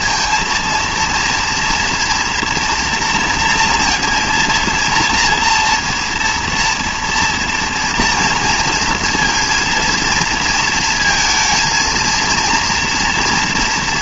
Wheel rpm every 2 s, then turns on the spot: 230, 230, 230, 240, 230, 220, 230.
none